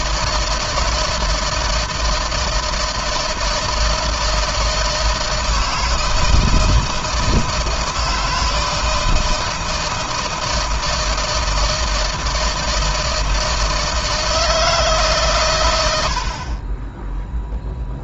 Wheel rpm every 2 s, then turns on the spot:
160, 160, 160, 160, 160, 160, 160, 150, 10.
none